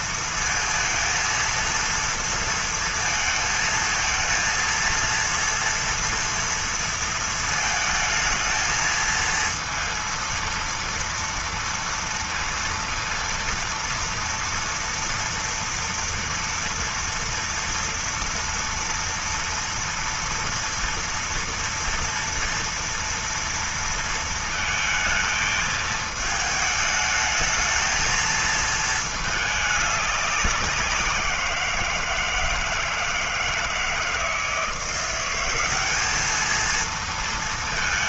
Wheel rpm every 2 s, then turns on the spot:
230, 230, 230, 230, 220, 230, 230, 230, 230, 230, 230, 240, 220, 220, 220, 190, 160, 170, 230.
none